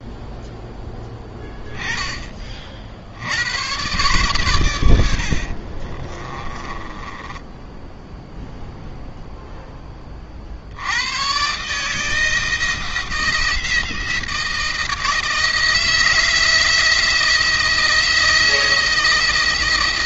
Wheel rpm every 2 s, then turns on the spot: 0, 50, 100, 20, 0, 80, 160, 160, 170, 160.
6-8